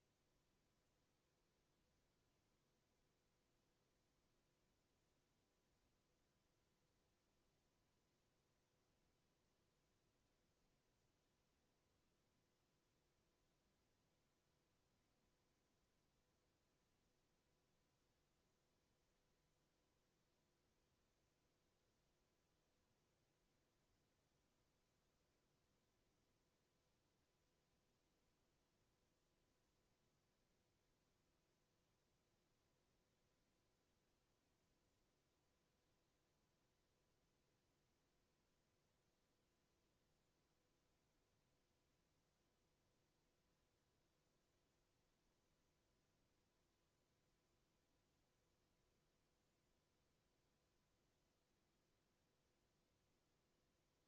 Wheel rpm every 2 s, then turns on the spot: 0, 0, 0, 0, 0, 0, 0, 0, 0, 0, 0, 0, 0, 0, 0, 0, 0, 0, 0, 0, 0, 0, 0, 0, 0, 0, 0.
none